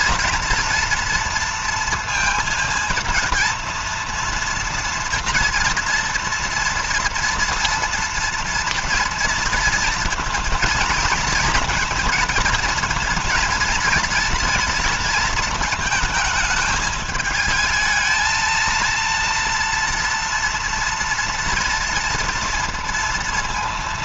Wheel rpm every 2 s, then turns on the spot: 230, 230, 230, 230, 230, 220, 230, 230, 220, 220, 230, 230.
none